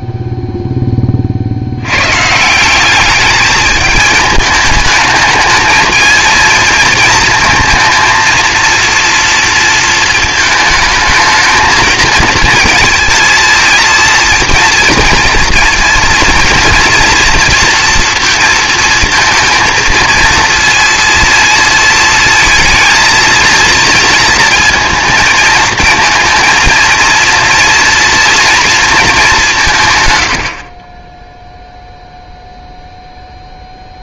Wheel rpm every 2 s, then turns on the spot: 0, 170, 210, 220, 230, 220, 230, 230, 230, 230, 230, 230, 230, 230, 230, 40, 0.
30-32